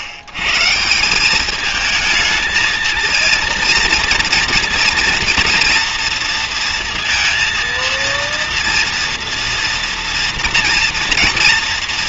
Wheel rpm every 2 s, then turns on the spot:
110, 220, 240, 230, 230, 230.
none